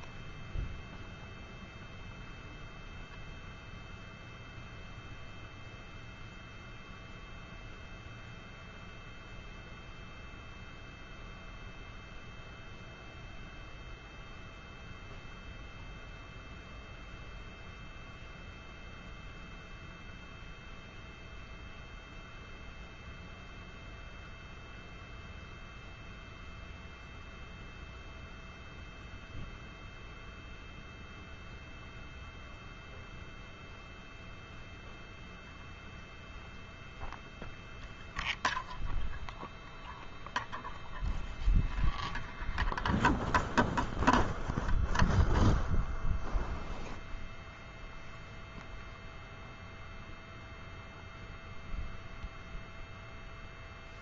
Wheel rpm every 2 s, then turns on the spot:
0, 0, 0, 0, 0, 0, 0, 0, 0, 0, 0, 0, 0, 0, 0, 0, 0, 0, 0, 0, 0, 0, 0, 0, 0, 0, 0.
none